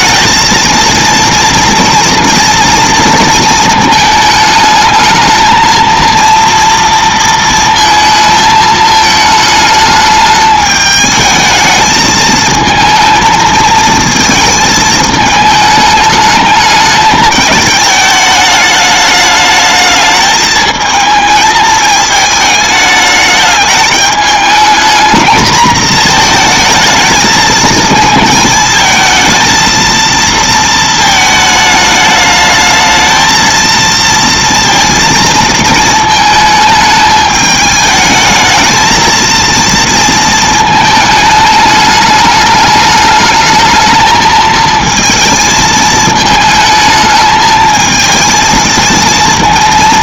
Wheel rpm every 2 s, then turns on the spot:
230, 230, 220, 230, 220, 210, 220, 220, 210, 210, 220, 220, 220, 220, 220, 230, 220, 230, 220, 220, 220, 210, 220, 220, 230.
none